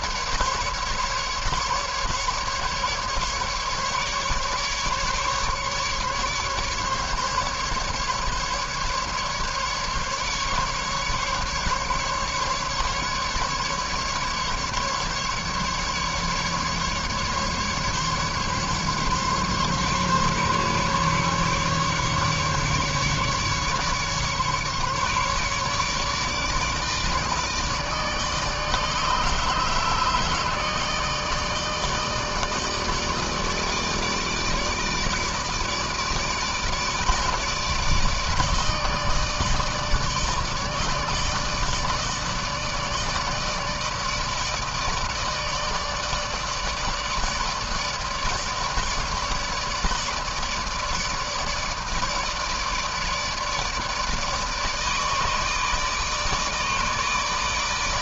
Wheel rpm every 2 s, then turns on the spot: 150, 150, 150, 150, 150, 150, 150, 150, 140, 140, 140, 140, 140, 150, 150, 150, 150, 160, 150, 150, 150, 150, 160, 160, 160, 160, 150, 150, 150.
none